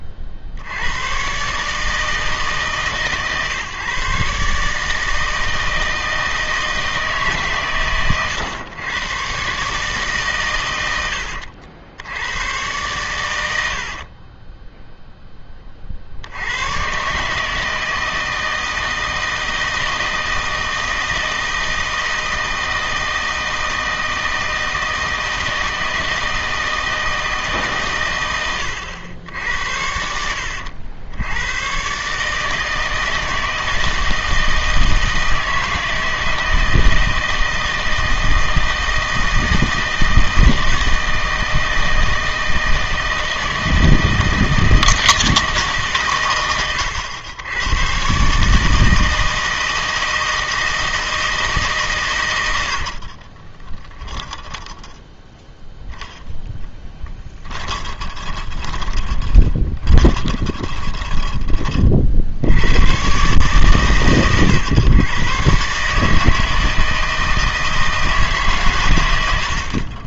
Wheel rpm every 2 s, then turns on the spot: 80, 140, 150, 160, 110, 110, 100, 0, 100, 160, 160, 160, 160, 160, 100, 90, 160, 160, 160, 160, 160, 160, 160, 110, 160, 160, 80, 0, 10, 20, 20, 70, 110, 160, 130.
52-54 58-62